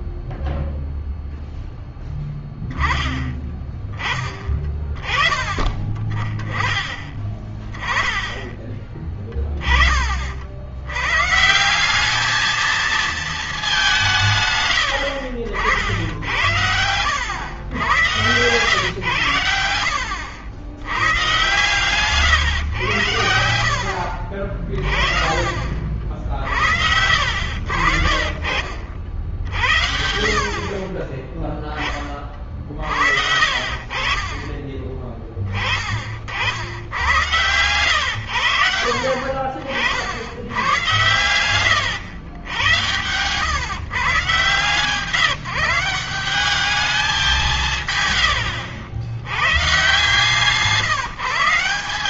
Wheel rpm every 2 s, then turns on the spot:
0, 10, 30, 30, 20, 60, 220, 140, 90, 110, 70, 120, 50, 60, 60, 70, 40, 30, 60, 90, 90, 90, 130, 190, 80, 140.
none